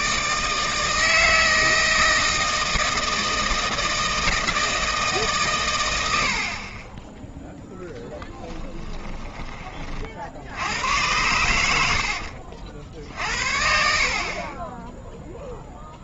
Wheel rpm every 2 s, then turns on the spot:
150, 160, 160, 30, 10, 90, 60, 20.
8-10